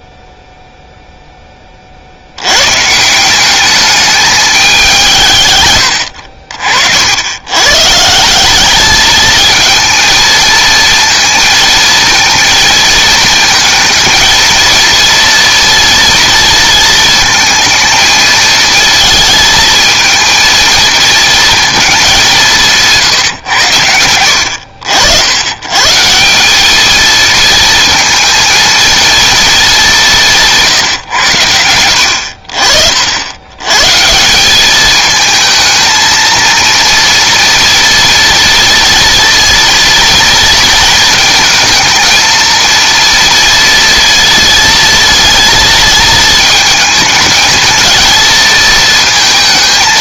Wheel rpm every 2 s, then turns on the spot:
0, 120, 200, 60, 210, 230, 220, 230, 230, 220, 230, 180, 80, 210, 230, 140, 60, 200, 230, 230, 220, 230, 230, 220, 220.
none